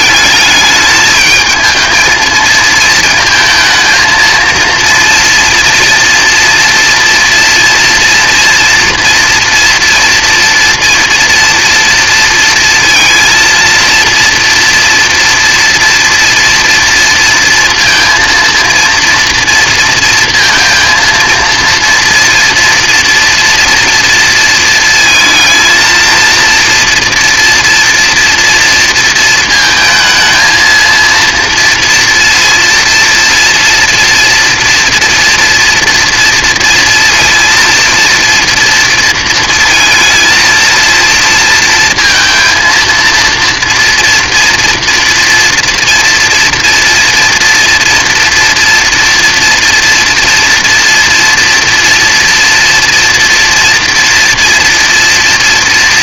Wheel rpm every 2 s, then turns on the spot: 210, 220, 230, 230, 230, 230, 230, 230, 230, 230, 230, 240, 230, 230, 230, 220, 230, 240, 230, 230, 230, 230, 230, 230, 240, 230, 230, 240.
none